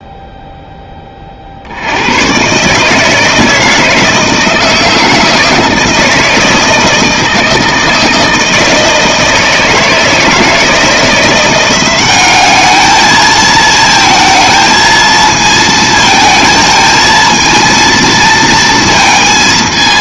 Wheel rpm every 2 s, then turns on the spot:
10, 140, 160, 160, 160, 160, 210, 230, 220, 230.
none